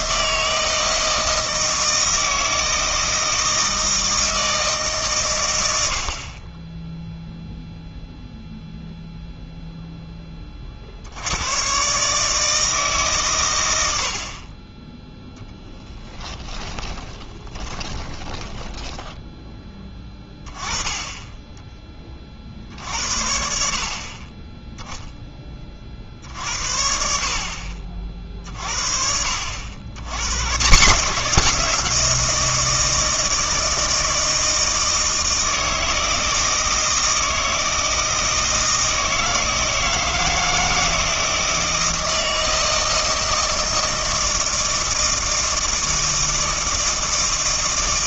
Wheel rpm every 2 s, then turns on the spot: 160, 160, 160, 20, 0, 40, 150, 20, 20, 20, 20, 50, 10, 60, 50, 140, 170, 160, 160, 160, 160, 160, 160, 160.
16-20